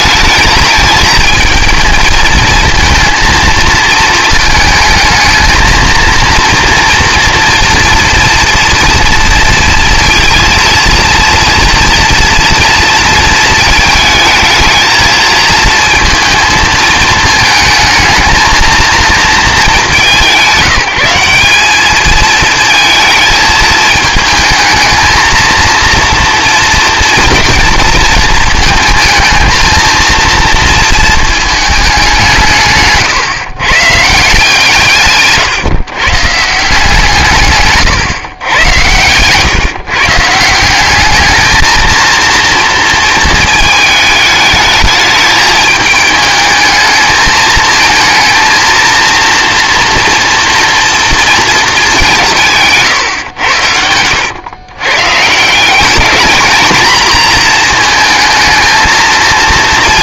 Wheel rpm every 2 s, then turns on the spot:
220, 230, 220, 230, 230, 230, 230, 220, 220, 220, 190, 220, 220, 240, 220, 230, 140, 160, 150, 110, 180, 230, 210, 220, 230, 230, 140, 110, 230, 230.
none